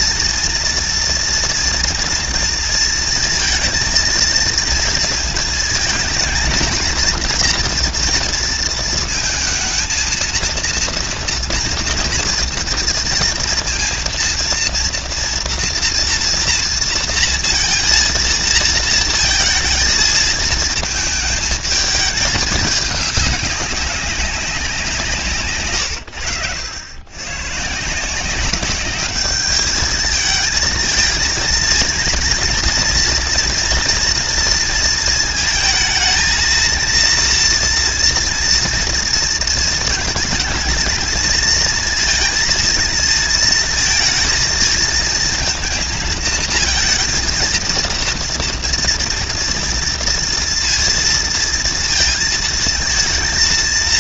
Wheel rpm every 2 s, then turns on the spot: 230, 230, 230, 230, 230, 230, 230, 230, 230, 230, 220, 210, 190, 90, 190, 220, 230, 230, 230, 230, 220, 230, 220, 220, 230, 230, 230.
none